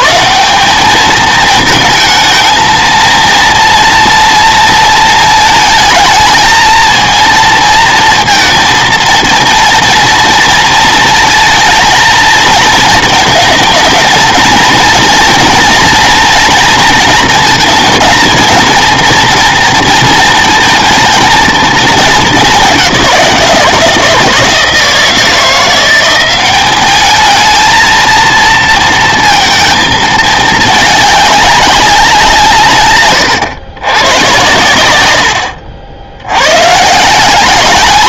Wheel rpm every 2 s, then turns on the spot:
190, 220, 230, 230, 230, 230, 220, 230, 240, 230, 230, 190, 160, 200, 230, 210, 150, 100, 110.
none